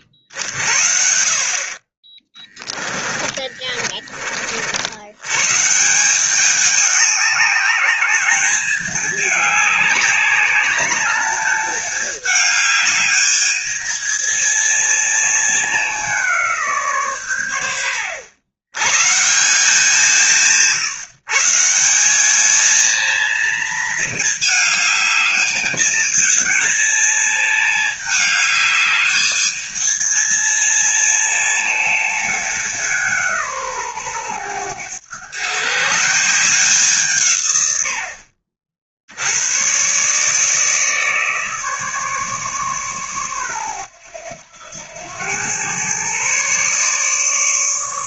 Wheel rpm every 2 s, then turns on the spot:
50, 20, 50, 190, 210, 200, 210, 220, 170, 100, 150, 220, 220, 220, 210, 220, 200, 110, 170, 50, 150, 140, 90, 130.
none